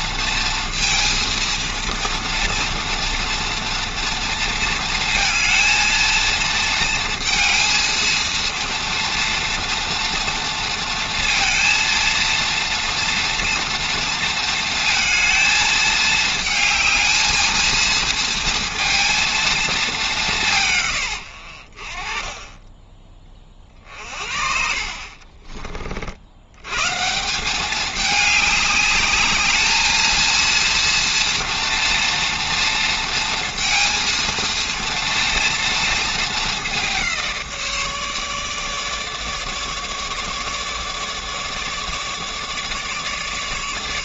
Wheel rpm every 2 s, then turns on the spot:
230, 230, 230, 230, 230, 230, 230, 230, 220, 230, 120, 20, 40, 140, 200, 230, 230, 230, 200, 150, 150, 150.
22-24